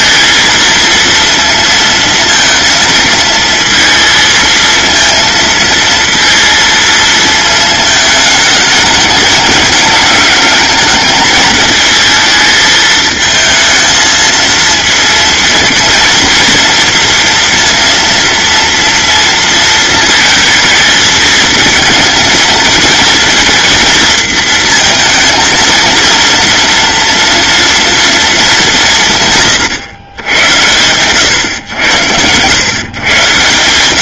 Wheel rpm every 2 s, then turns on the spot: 230, 230, 230, 220, 210, 210, 220, 230, 230, 230, 220, 230, 230, 230, 150, 120, 120.
none